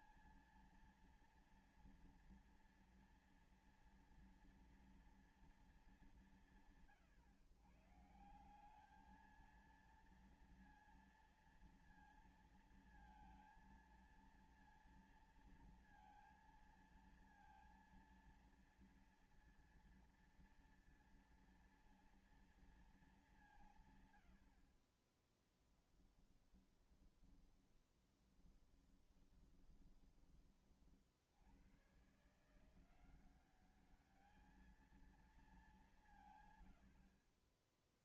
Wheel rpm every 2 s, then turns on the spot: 230, 230, 230, 190, 180, 230, 230, 230, 230, 230, 230, 230, 70, 10, 20, 30, 150, 210, 130.
28-30